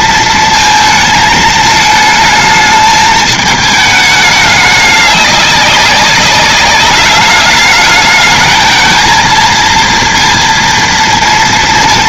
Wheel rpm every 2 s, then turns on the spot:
230, 220, 210, 200, 220, 230.
none